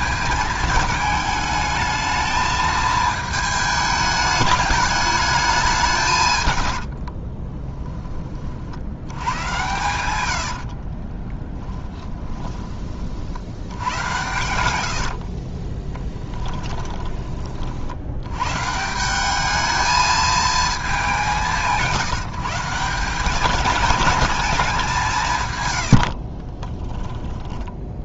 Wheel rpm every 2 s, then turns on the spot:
220, 220, 210, 90, 60, 70, 20, 90, 20, 140, 220, 160, 200, 30.
6-8 10-12 14-18 26-28